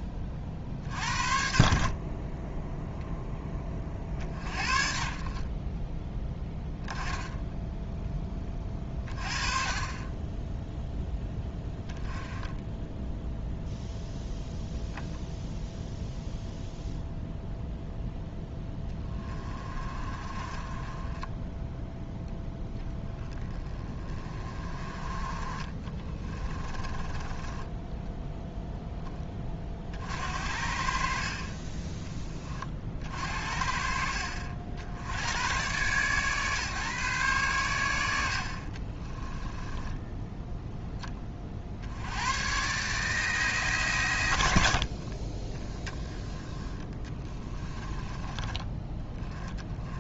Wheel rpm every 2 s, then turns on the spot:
50, 0, 50, 10, 30, 0, 10, 0, 0, 10, 10, 10, 30, 20, 10, 50, 50, 70, 140, 40, 20, 140, 70, 20, 20.
6-8 26-28 38-40 44-48